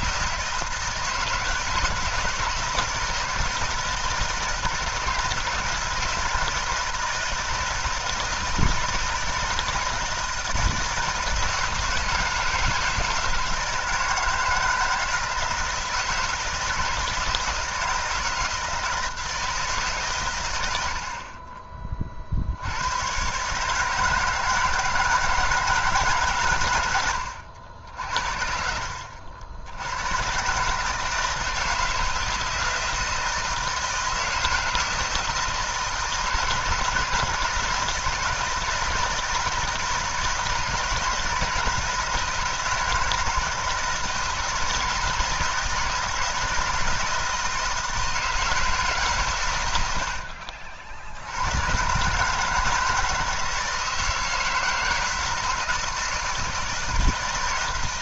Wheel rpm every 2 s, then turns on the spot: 160, 160, 160, 160, 160, 160, 160, 160, 160, 160, 70, 110, 160, 80, 70, 150, 160, 160, 160, 160, 160, 160, 160, 160, 150, 70, 160, 160, 160.
none